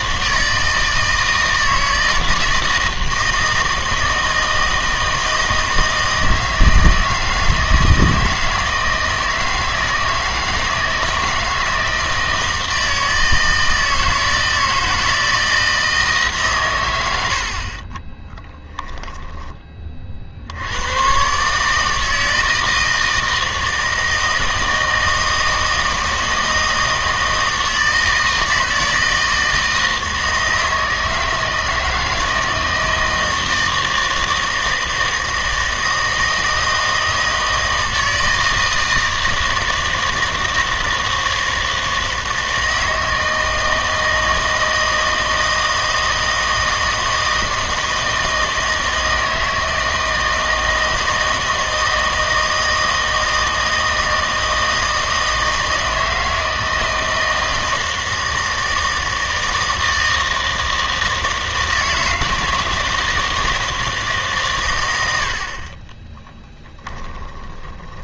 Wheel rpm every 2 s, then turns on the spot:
160, 160, 160, 160, 160, 160, 160, 160, 120, 10, 80, 160, 160, 160, 160, 160, 160, 160, 160, 160, 160, 160, 160, 160, 160, 160, 160, 160, 160, 160, 160, 160, 120, 10.
66-68